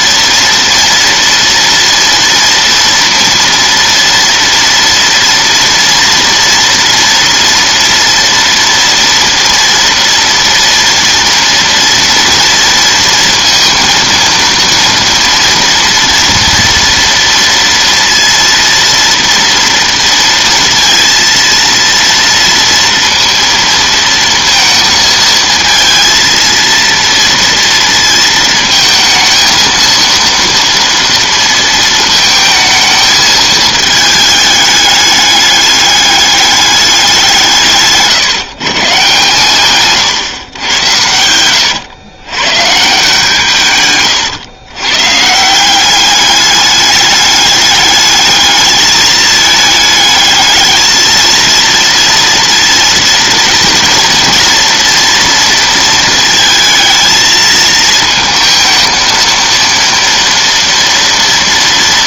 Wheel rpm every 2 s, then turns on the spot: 230, 230, 230, 230, 230, 230, 230, 230, 230, 230, 230, 230, 230, 230, 220, 230, 220, 210, 200, 140, 110, 140, 120, 210, 210, 220, 230, 230, 220, 220, 230.
none